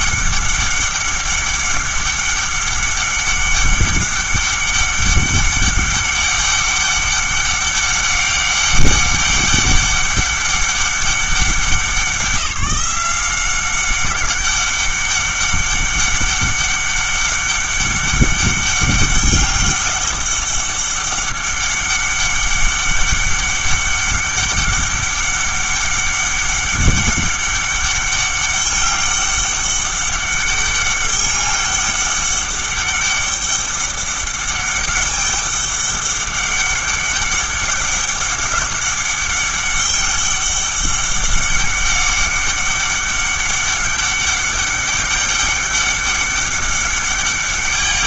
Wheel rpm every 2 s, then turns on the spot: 200, 200, 200, 200, 200, 200, 180, 200, 200, 200, 200, 200, 200, 200, 200, 200, 200, 200, 200, 200, 200, 200, 200, 200.
none